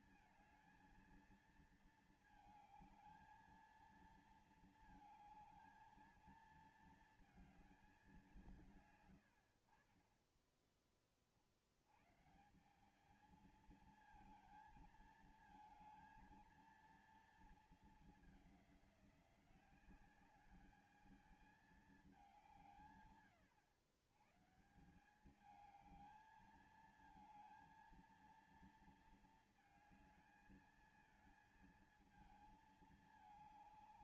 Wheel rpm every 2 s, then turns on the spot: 230, 220, 230, 220, 190, 40, 120, 220, 220, 210, 200, 200, 140, 220, 230, 220, 220.
none